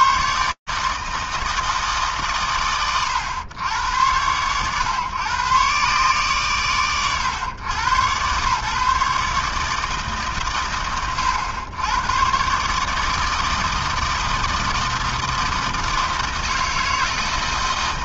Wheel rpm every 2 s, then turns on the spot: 90, 140, 100, 130, 110, 140, 100, 160, 160.
none